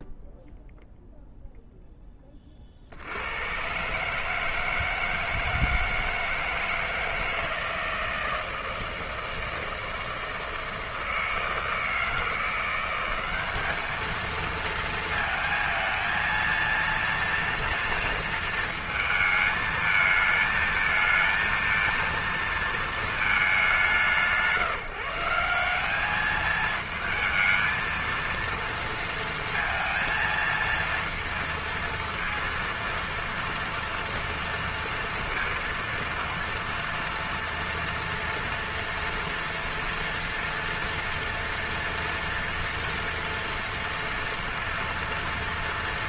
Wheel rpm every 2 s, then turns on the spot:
0, 20, 150, 160, 160, 160, 170, 220, 230, 230, 220, 230, 160, 210, 230, 230, 230, 230, 230, 230, 230, 230, 230.
none